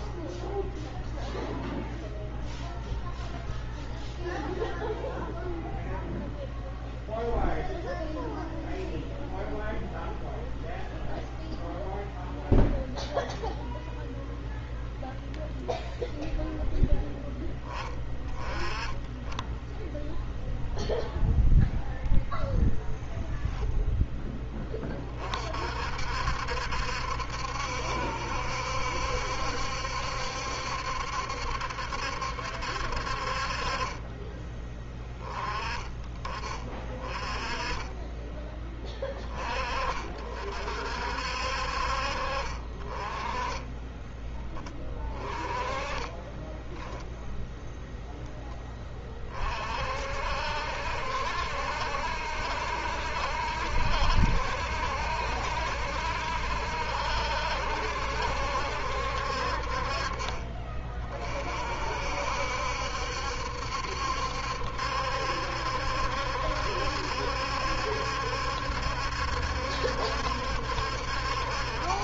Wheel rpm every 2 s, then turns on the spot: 0, 0, 0, 0, 0, 0, 0, 0, 10, 20, 0, 0, 20, 70, 70, 70, 60, 20, 30, 10, 50, 30, 20, 10, 20, 60, 70, 70, 70, 60, 40, 70, 70, 70, 70, 70.
none